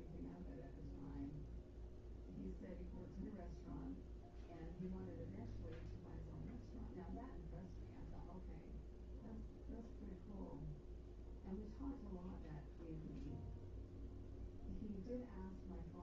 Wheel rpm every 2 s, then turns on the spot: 0, 0, 0, 0, 0, 0, 0, 0.
none